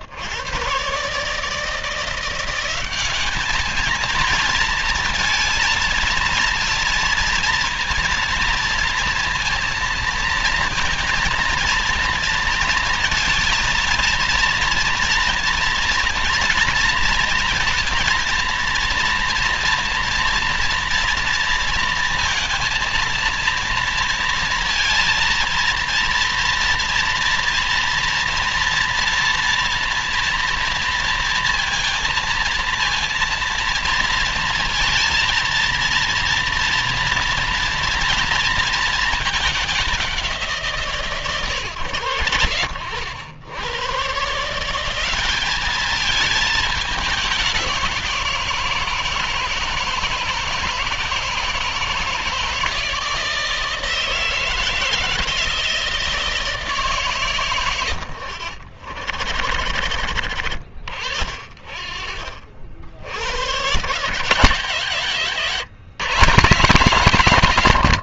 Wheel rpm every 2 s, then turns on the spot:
120, 190, 230, 230, 230, 230, 230, 230, 230, 230, 230, 230, 230, 230, 230, 230, 230, 230, 230, 220, 140, 80, 180, 200, 160, 160, 160, 160, 140, 80, 50, 70, 150, 140.
none